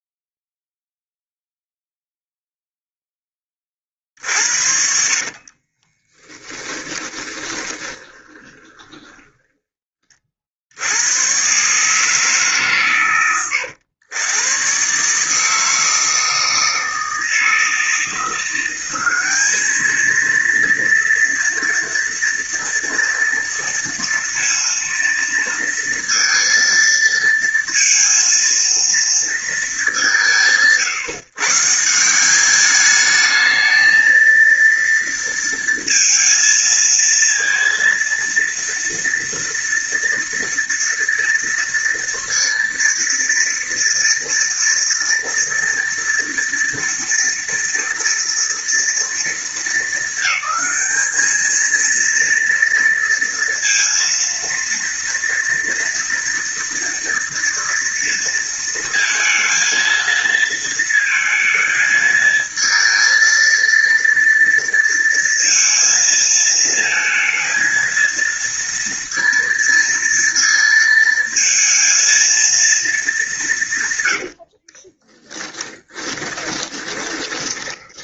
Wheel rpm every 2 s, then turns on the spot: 0, 0, 50, 10, 20, 60, 140, 120, 160, 180, 230, 230, 230, 230, 230, 160, 200, 230, 230, 230, 230, 230, 230, 230, 230, 210, 230, 230, 230, 230, 230, 220, 230, 230, 230, 230, 230, 70, 20.
4-10 74-78